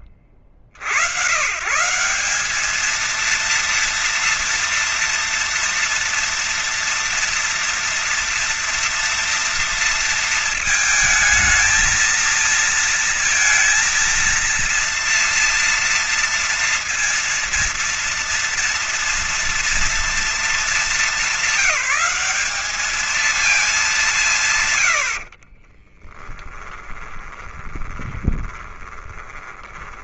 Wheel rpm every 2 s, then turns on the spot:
60, 210, 230, 230, 230, 230, 230, 230, 230, 230, 210, 210, 130, 10, 20.
24-30